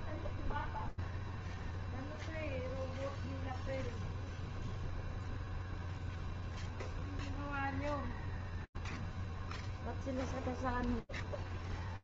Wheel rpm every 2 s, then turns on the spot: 0, 0, 0, 0, 0, 0.
none